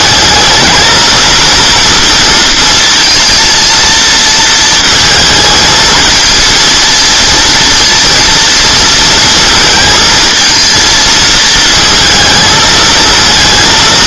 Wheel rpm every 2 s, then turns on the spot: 220, 230, 220, 220, 230, 230, 220.
none